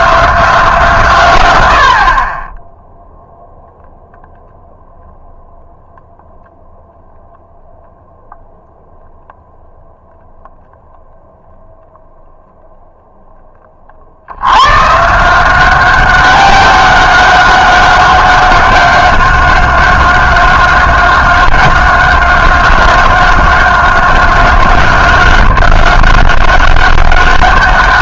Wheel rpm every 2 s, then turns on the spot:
170, 10, 0, 0, 0, 0, 0, 110, 190, 190, 190, 190, 190, 200.
none